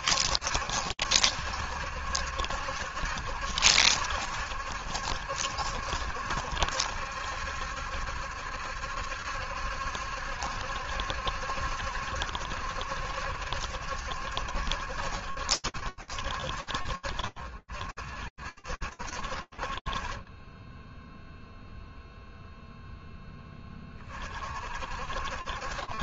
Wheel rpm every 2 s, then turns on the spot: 70, 70, 70, 70, 70, 70, 70, 70, 50, 40, 0, 10, 70.
none